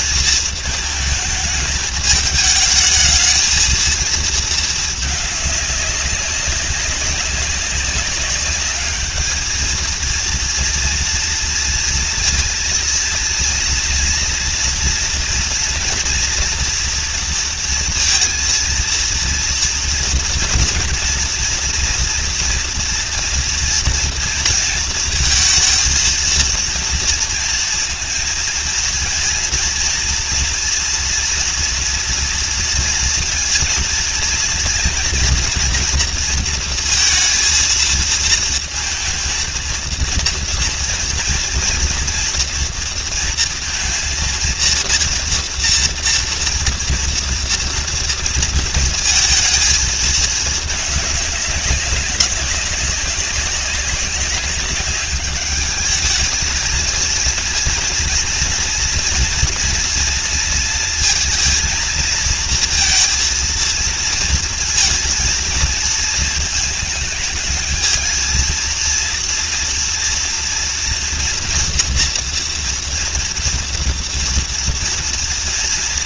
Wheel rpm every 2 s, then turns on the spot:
220, 210, 210, 200, 210, 230, 230, 230, 230, 230, 240, 230, 230, 230, 230, 230, 230, 230, 230, 230, 230, 230, 230, 240, 230, 210, 190, 190, 220, 230, 230, 230, 230, 220, 230, 230, 240, 240.
none